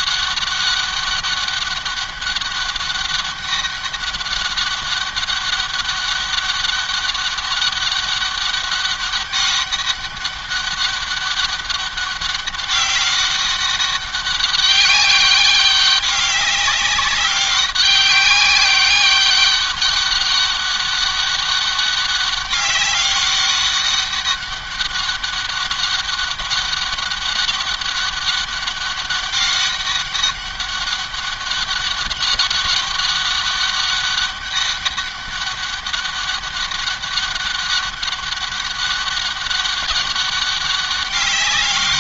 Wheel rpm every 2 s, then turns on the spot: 200, 200, 200, 200, 200, 200, 200, 200, 190, 200, 200, 200, 200, 200, 200, 200, 200, 200, 200, 200, 200.
none